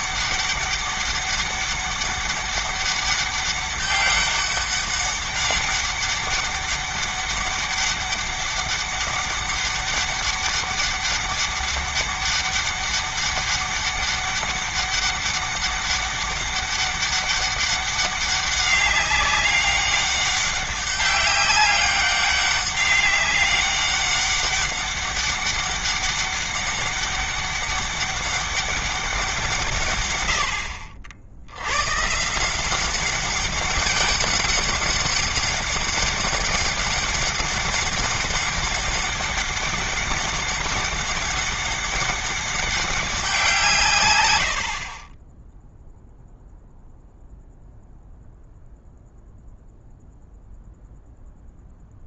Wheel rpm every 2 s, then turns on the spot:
200, 200, 200, 200, 200, 200, 200, 200, 200, 200, 200, 200, 200, 200, 200, 80, 180, 200, 200, 200, 200, 200, 70, 0, 0, 0.
none